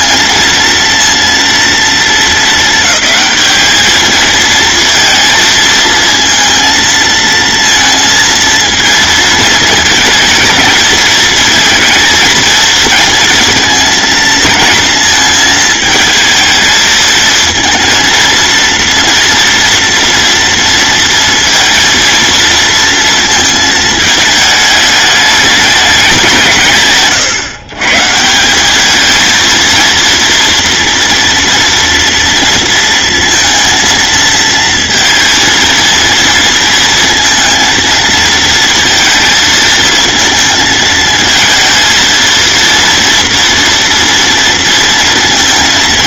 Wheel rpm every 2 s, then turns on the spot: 230, 220, 230, 230, 220, 220, 230, 230, 220, 230, 230, 230, 210, 140, 220, 230, 230, 230, 230, 220, 220, 230, 230.
none